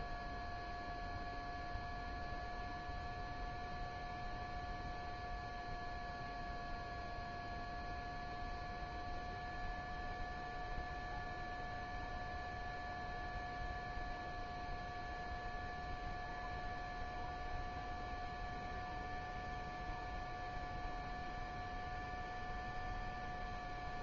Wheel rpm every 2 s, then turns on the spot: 0, 0, 0, 0, 0, 0, 0, 0, 0, 0, 0, 0.
none